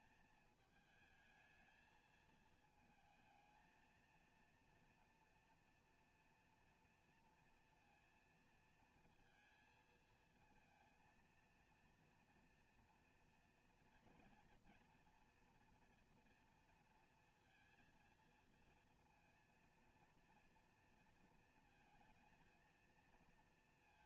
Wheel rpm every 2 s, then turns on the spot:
220, 220, 230, 230, 230, 220, 230, 230, 230, 230, 230, 230.
none